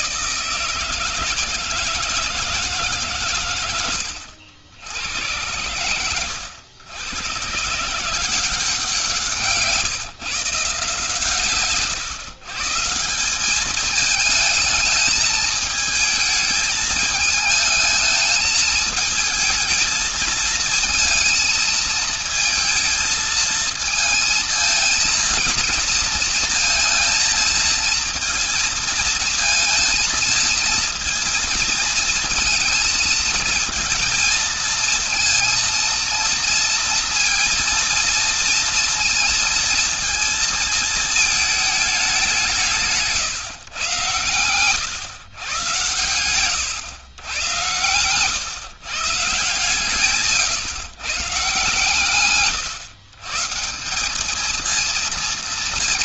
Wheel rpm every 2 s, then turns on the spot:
160, 150, 80, 90, 180, 150, 140, 220, 220, 220, 220, 220, 230, 230, 230, 230, 230, 230, 230, 230, 220, 180, 100, 120, 140, 140, 130, 220.
none